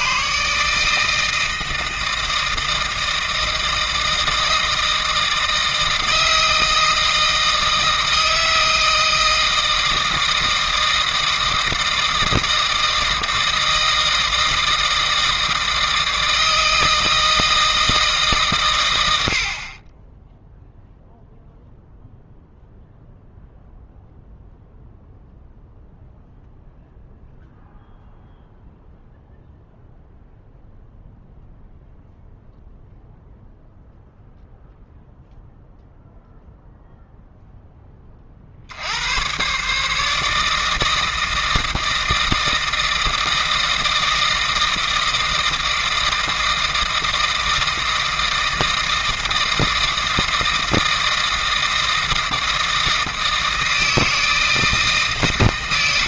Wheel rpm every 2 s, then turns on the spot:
150, 160, 160, 160, 160, 160, 160, 160, 160, 130, 0, 0, 0, 0, 0, 0, 0, 0, 0, 70, 160, 160, 160, 160, 160, 160, 160, 160.
none